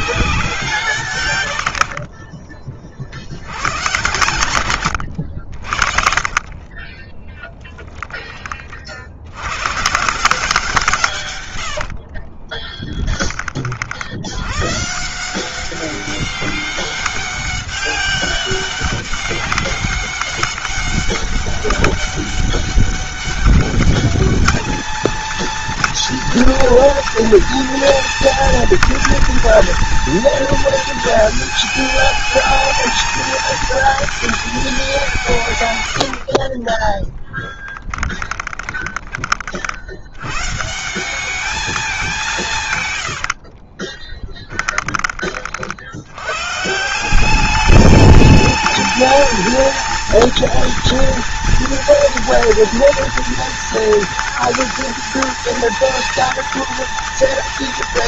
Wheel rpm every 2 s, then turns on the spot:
130, 70, 80, 20, 70, 140, 10, 150, 200, 200, 200, 200, 220, 240, 230, 220, 220, 180, 20, 30, 180, 130, 30, 180, 220, 230, 230, 230, 230.
6-8 36-38 42-44